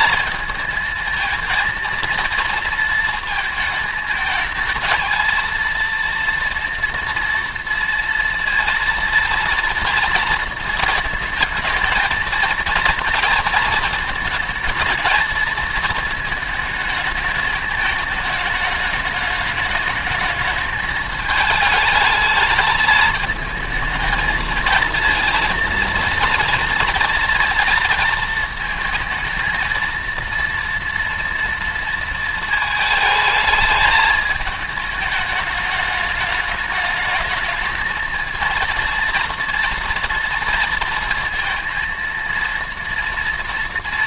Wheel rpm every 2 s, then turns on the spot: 220, 230, 220, 230, 230, 230, 230, 220, 220, 210, 210, 220, 220, 230, 220, 230, 220, 220, 210, 230, 230, 230.
none